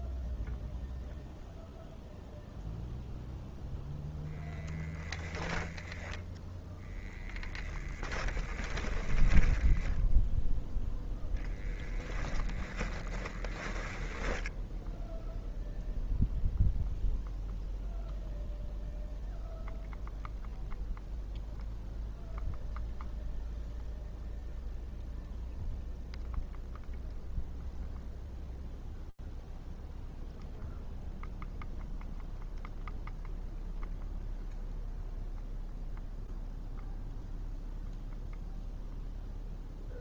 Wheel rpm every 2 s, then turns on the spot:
0, 0, 0, 10, 10, 0, 10, 10, 0, 0, 0, 0, 0, 0, 0, 0, 0, 0, 0, 0.
6-10 12-14